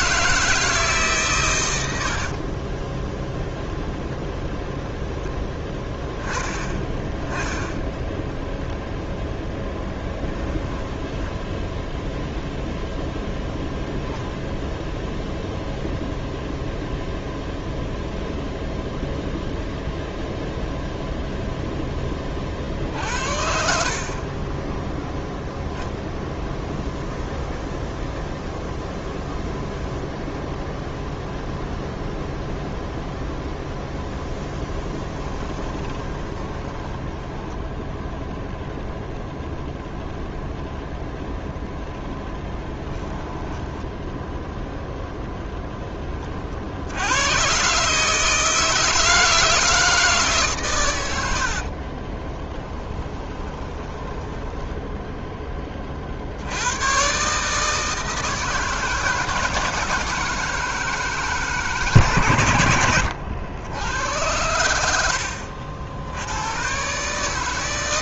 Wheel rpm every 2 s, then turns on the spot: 160, 20, 10, 20, 0, 20, 0, 0, 0, 0, 0, 50, 10, 0, 0, 0, 0, 10, 10, 0, 0, 10, 0, 70, 160, 110, 10, 10, 100, 160, 160, 100, 80, 130.
2-4 10-12 34-38 42-44 52-56